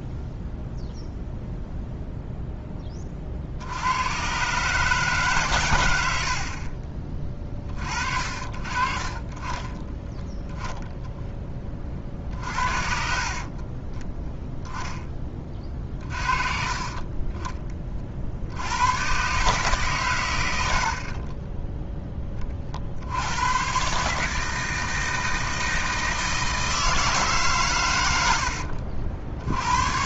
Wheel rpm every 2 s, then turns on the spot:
0, 10, 130, 40, 40, 0, 50, 0, 30, 70, 50, 50, 160, 160, 70.
20-22